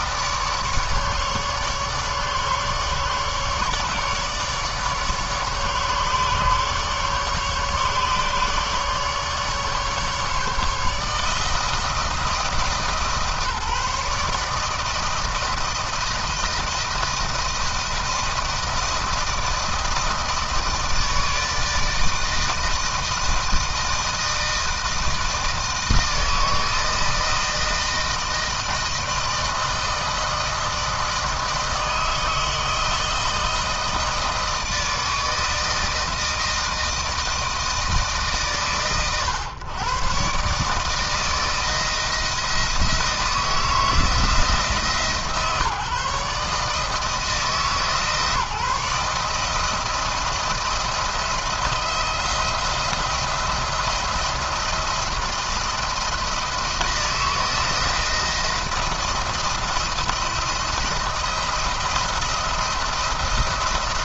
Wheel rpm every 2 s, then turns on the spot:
150, 150, 150, 150, 150, 150, 160, 160, 170, 160, 160, 160, 160, 160, 160, 160, 160, 160, 170, 130, 160, 170, 160, 150, 150, 160, 170, 170, 160, 170, 160, 160.
none